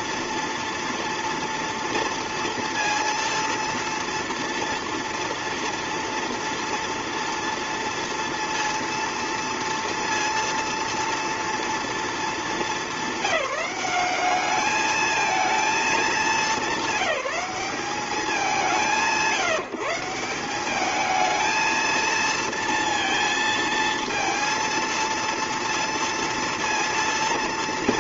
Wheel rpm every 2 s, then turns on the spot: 230, 230, 230, 230, 230, 230, 210, 210, 210, 180, 190, 230, 230, 230.
none